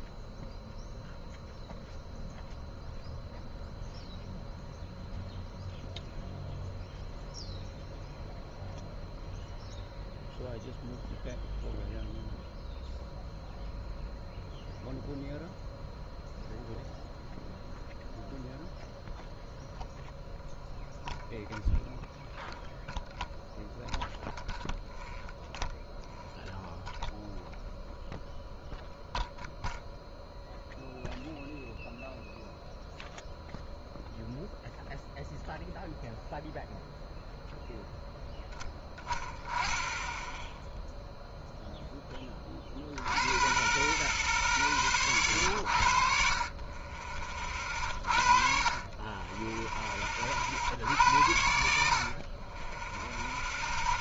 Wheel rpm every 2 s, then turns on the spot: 0, 0, 0, 0, 0, 0, 0, 0, 0, 0, 0, 0, 0, 0, 0, 0, 0, 0, 0, 10, 0, 30, 20, 30, 40, 60, 20.
none